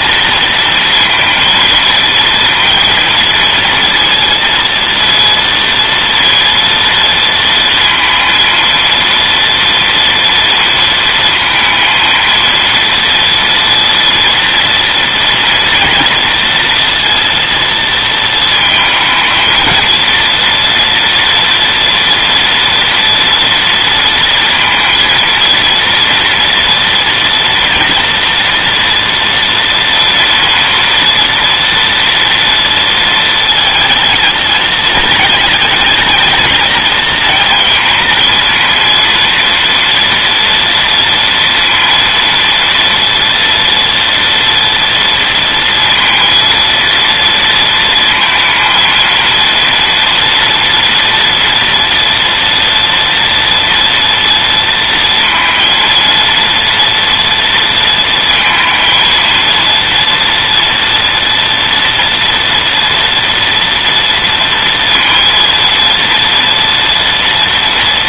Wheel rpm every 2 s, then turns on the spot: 230, 230, 230, 230, 230, 230, 230, 230, 230, 220, 230, 230, 230, 230, 230, 230, 230, 220, 220, 230, 230, 230, 230, 230, 230, 230, 230, 230, 230, 230, 230, 240, 230, 230.
none